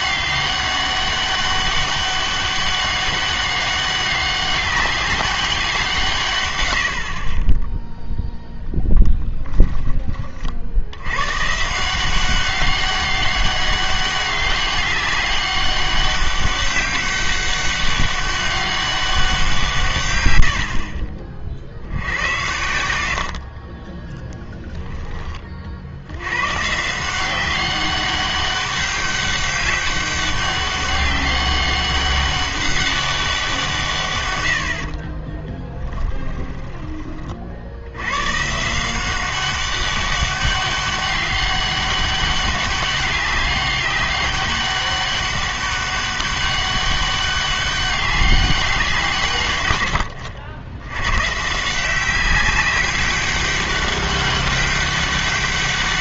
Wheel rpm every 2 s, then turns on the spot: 200, 200, 200, 90, 0, 60, 190, 190, 200, 200, 70, 90, 10, 150, 200, 200, 200, 70, 20, 170, 200, 200, 200, 200, 190, 90, 190, 200.
6-8 20-22